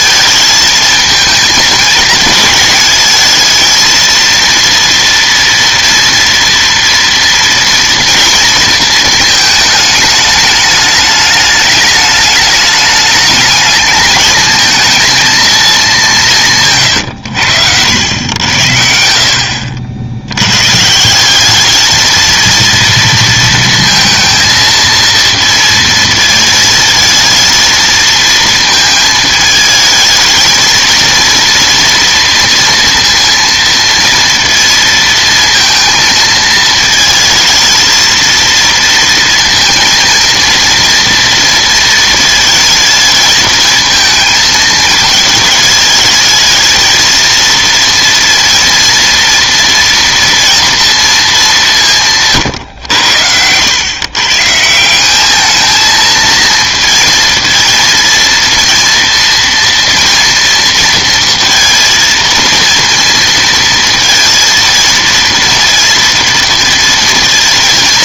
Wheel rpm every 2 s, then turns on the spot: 220, 210, 230, 230, 230, 210, 210, 220, 140, 70, 130, 230, 230, 230, 230, 230, 230, 230, 220, 230, 230, 230, 220, 220, 230, 230, 120, 160, 230, 230, 230, 230, 230, 230.
none